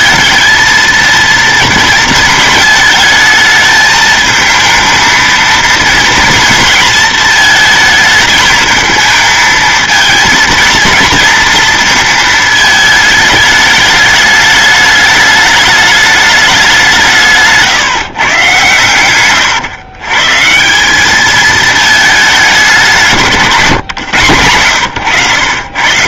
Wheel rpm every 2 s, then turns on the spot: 220, 220, 220, 220, 220, 230, 220, 210, 200, 130, 160, 200, 120.
none